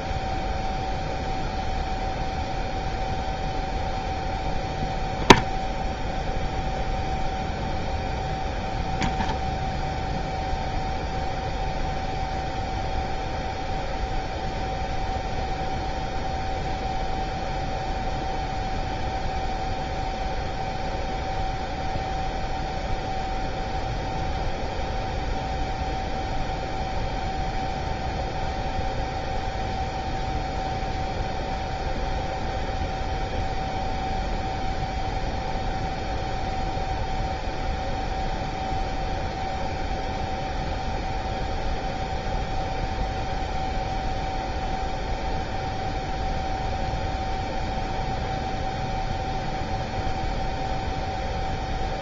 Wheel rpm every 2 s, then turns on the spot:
0, 0, 0, 0, 0, 0, 0, 0, 0, 0, 0, 0, 0, 0, 0, 0, 0, 0, 0, 0, 0, 0, 0, 0, 0, 0.
none